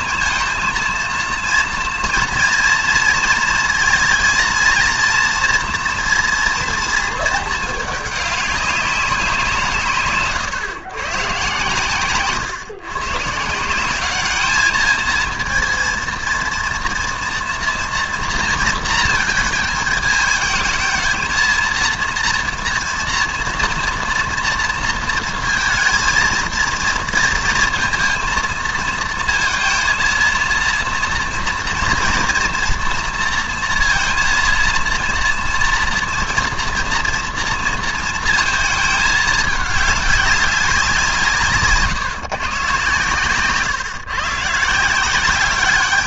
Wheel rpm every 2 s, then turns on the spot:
230, 230, 230, 230, 200, 130, 120, 210, 230, 230, 220, 230, 230, 230, 220, 230, 230, 230, 230, 220, 180, 130, 160.
none